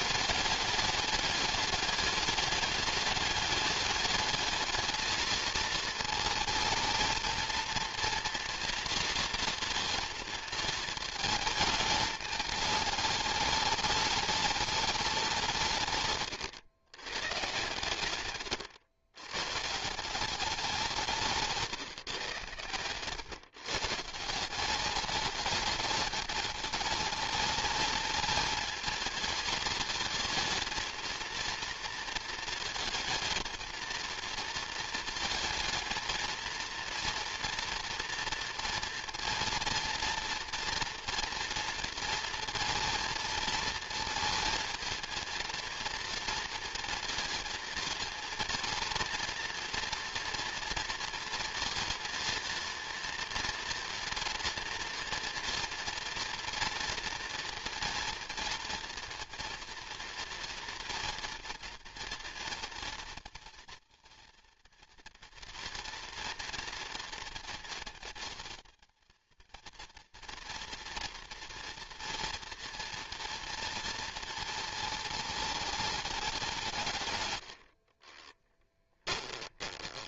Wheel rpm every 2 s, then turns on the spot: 210, 210, 220, 220, 230, 220, 210, 210, 140, 110, 180, 120, 190, 210, 220, 220, 220, 230, 240, 230, 230, 230, 220, 230, 230, 230, 230, 230, 230, 240, 230, 230, 230, 230, 220, 230, 230, 220, 160, 10.
22-24 78-80